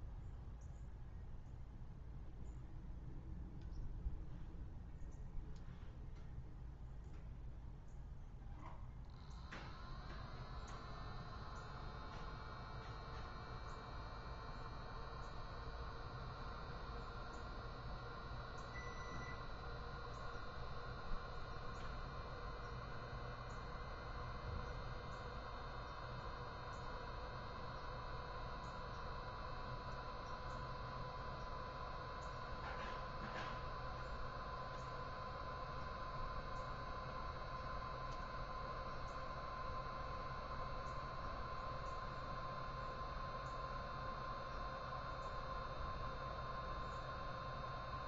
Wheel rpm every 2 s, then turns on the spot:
0, 0, 0, 0, 0, 0, 0, 0, 0, 0, 0, 0, 0, 0, 0, 0, 0, 0, 0, 0, 0, 0, 0, 0.
none